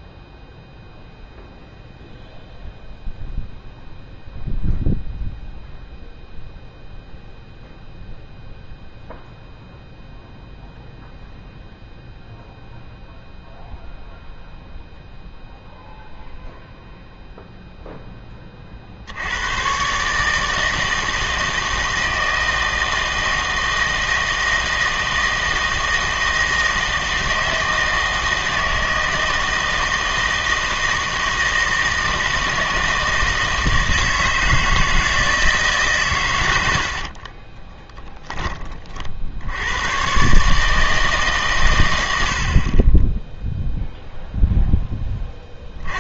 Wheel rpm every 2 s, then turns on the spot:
0, 0, 0, 0, 0, 0, 0, 0, 0, 40, 160, 160, 160, 160, 160, 160, 160, 160, 70, 40, 150, 40, 0.
36-38